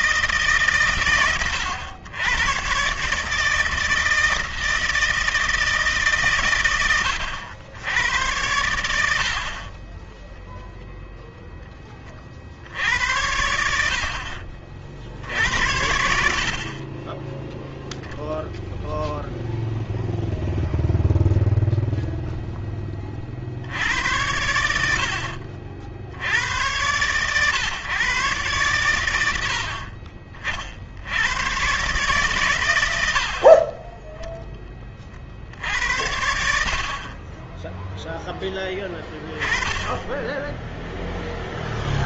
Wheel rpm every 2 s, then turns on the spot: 150, 110, 160, 120, 90, 10, 40, 60, 60, 0, 0, 0, 90, 80, 120, 50, 150, 20, 70, 10, 10.
none